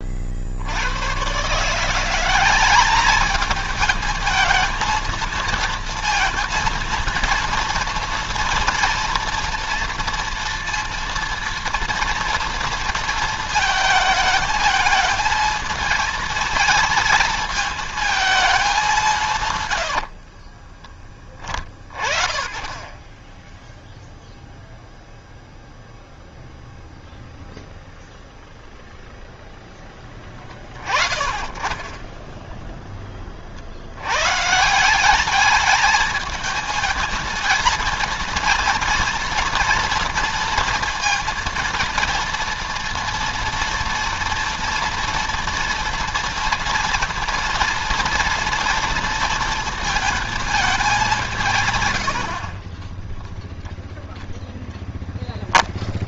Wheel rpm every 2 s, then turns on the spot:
80, 200, 220, 230, 230, 230, 230, 220, 220, 200, 30, 30, 0, 0, 0, 20, 10, 170, 220, 230, 230, 230, 230, 230, 230, 220, 30, 0.
20-22 52-54